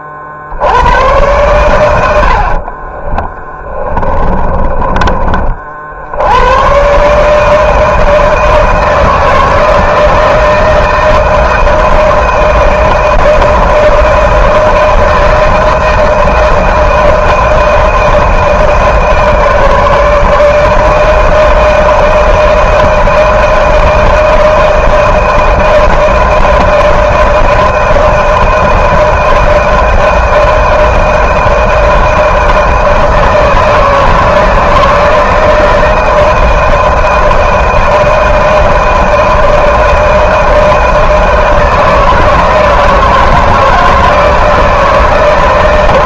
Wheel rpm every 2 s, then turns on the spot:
60, 70, 40, 110, 160, 160, 170, 160, 160, 160, 160, 160, 160, 160, 160, 160, 160, 160, 160, 160, 160, 160, 160.
2-6